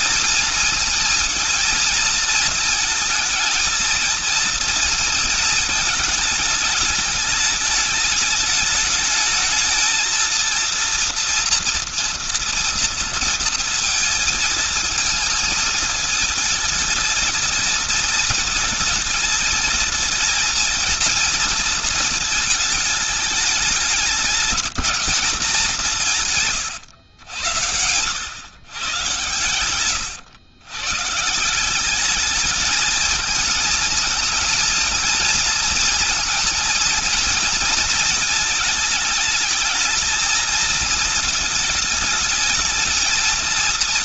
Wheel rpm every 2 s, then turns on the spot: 220, 220, 230, 220, 210, 230, 230, 220, 220, 220, 220, 220, 210, 110, 120, 120, 220, 230, 230, 220, 220, 220.
none